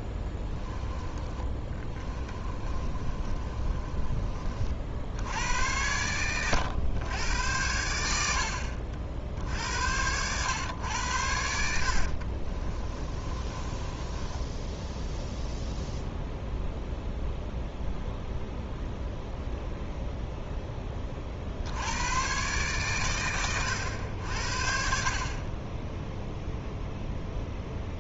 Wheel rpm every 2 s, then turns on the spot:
10, 30, 40, 110, 60, 110, 40, 10, 0, 0, 10, 120, 60, 0.
0-4 12-16